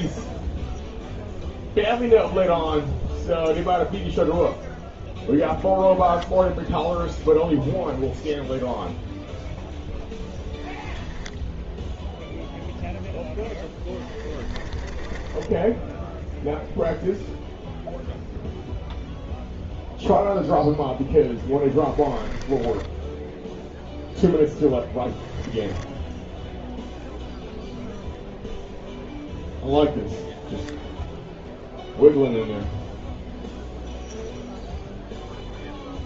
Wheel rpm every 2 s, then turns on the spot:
0, 0, 0, 0, 0, 10, 0, 20, 0, 0, 0, 10, 0, 0, 0, 0, 0, 0.
10-12 14-16 22-24